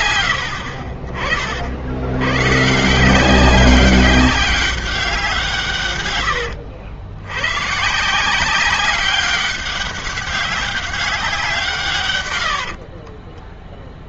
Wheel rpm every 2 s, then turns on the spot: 70, 120, 190, 100, 160, 190, 90.
6-8 12-14